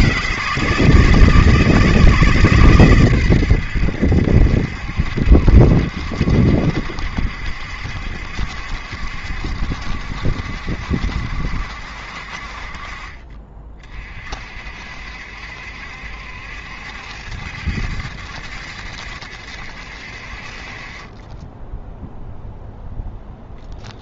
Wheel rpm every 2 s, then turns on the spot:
160, 130, 70, 70, 70, 70, 40, 60, 70, 70, 30, 0.
none